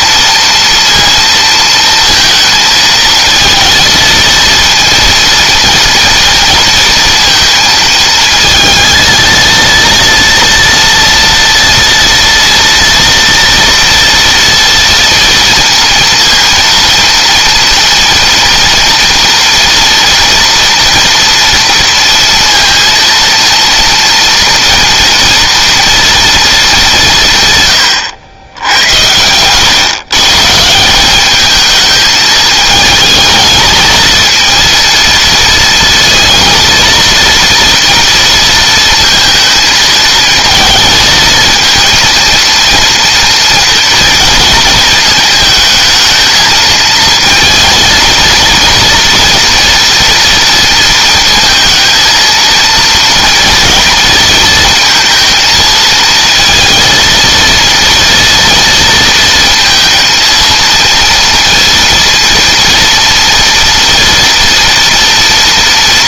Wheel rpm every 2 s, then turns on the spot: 230, 220, 230, 230, 220, 230, 230, 230, 230, 230, 240, 230, 230, 190, 90, 180, 220, 230, 230, 230, 220, 230, 220, 220, 230, 230, 230, 230, 230, 230, 230, 230, 240.
none